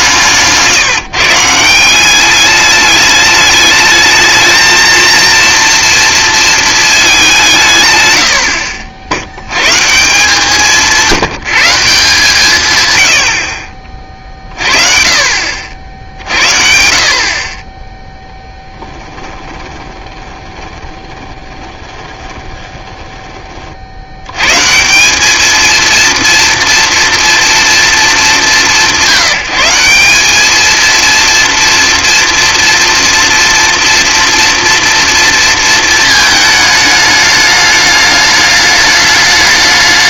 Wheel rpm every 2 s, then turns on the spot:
170, 210, 220, 220, 60, 170, 110, 40, 60, 10, 20, 20, 140, 230, 150, 210, 230, 230, 210, 210.
18-24